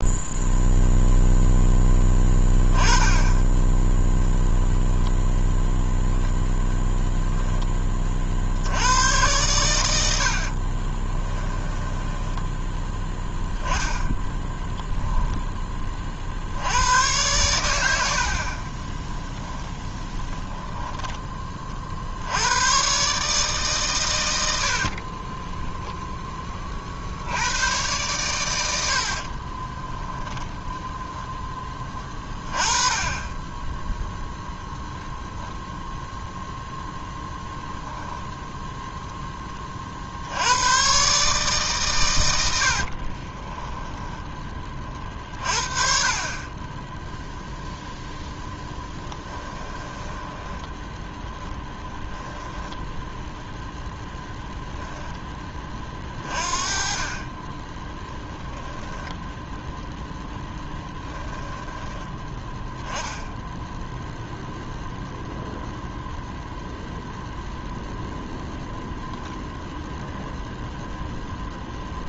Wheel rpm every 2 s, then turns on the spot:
0, 10, 10, 10, 70, 50, 10, 10, 80, 30, 10, 110, 70, 30, 90, 10, 20, 10, 0, 10, 100, 70, 20, 40, 10, 10, 10, 0, 30, 10, 10, 10, 0, 0, 0, 0.
6-8 10-12 14-16 18-20 42-44 48-54 58-62